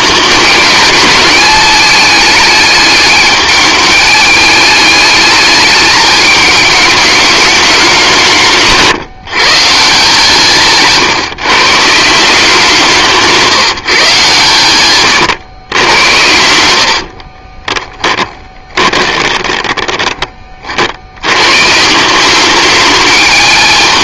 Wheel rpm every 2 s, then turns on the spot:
210, 210, 210, 210, 150, 140, 170, 120, 70, 20, 70, 210.
14-20